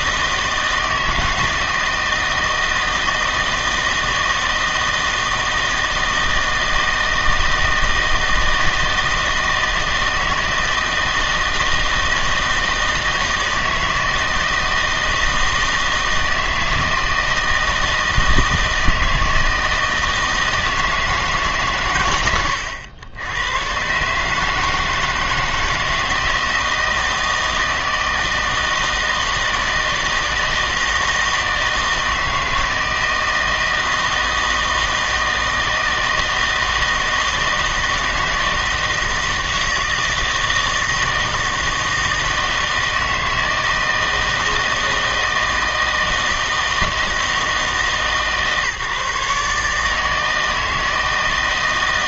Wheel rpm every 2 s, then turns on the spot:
160, 160, 160, 160, 160, 160, 160, 160, 160, 160, 160, 100, 150, 160, 160, 160, 160, 160, 160, 160, 160, 160, 160, 160, 140, 160.
none